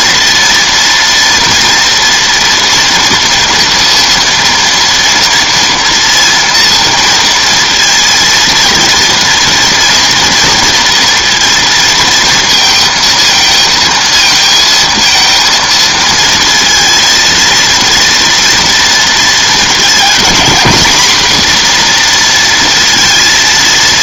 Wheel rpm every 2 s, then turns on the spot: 230, 240, 230, 230, 230, 230, 230, 230, 230, 230, 230, 230.
none